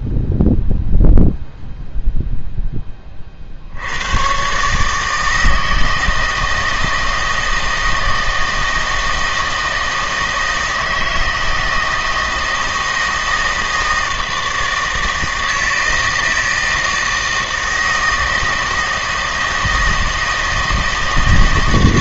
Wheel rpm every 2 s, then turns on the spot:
0, 0, 130, 160, 160, 160, 160, 160, 160, 160, 160.
none